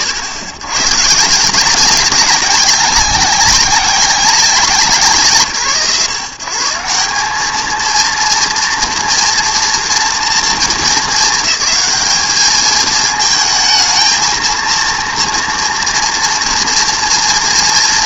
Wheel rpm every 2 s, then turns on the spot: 100, 190, 160, 130, 230, 220, 210, 230, 230.
none